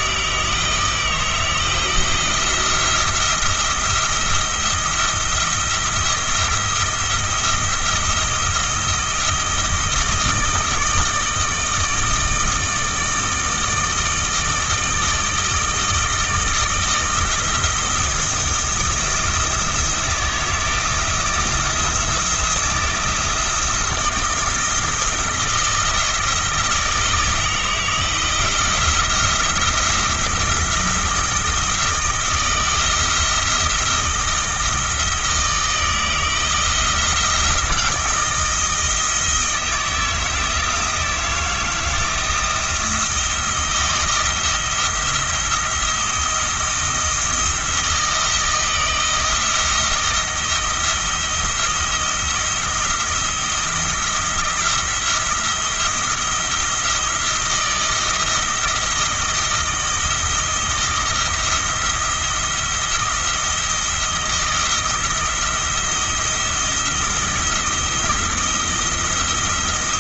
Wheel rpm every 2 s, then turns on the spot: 160, 170, 170, 170, 170, 160, 160, 160, 160, 160, 170, 170, 170, 160, 170, 160, 160, 160, 170, 160, 160, 170, 170, 170, 160, 170, 170, 170, 170, 160, 160, 170, 170, 170, 170.
none